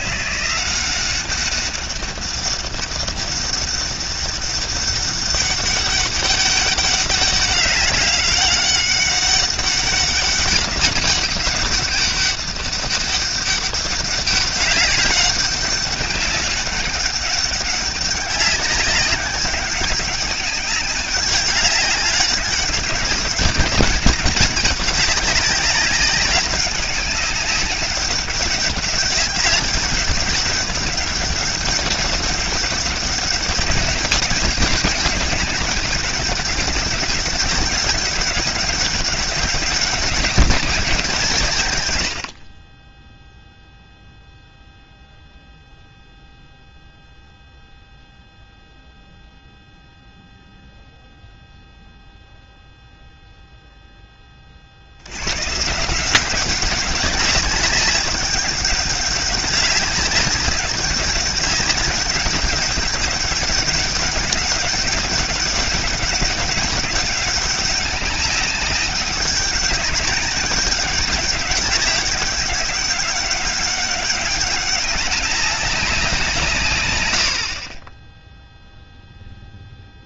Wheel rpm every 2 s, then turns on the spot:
150, 200, 200, 200, 200, 200, 200, 200, 200, 200, 200, 200, 190, 190, 190, 200, 200, 200, 200, 190, 200, 120, 0, 0, 0, 0, 0, 0, 150, 200, 200, 200, 200, 200, 190, 210, 200, 200, 200, 50.
none